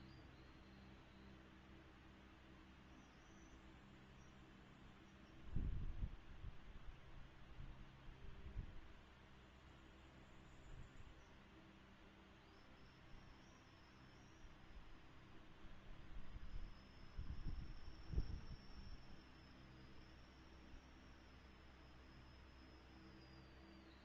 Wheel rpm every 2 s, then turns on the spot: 0, 0, 0, 0, 0, 0, 0, 0, 0, 0, 0, 0.
none